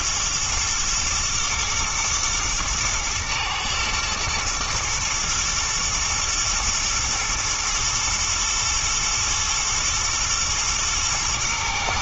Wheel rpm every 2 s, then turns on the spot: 110, 110, 120, 110, 120, 110.
none